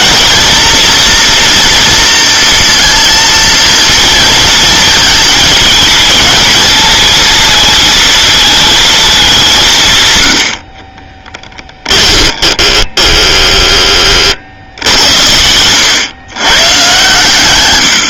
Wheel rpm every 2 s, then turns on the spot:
230, 230, 220, 220, 220, 60, 10, 70, 130.
12-14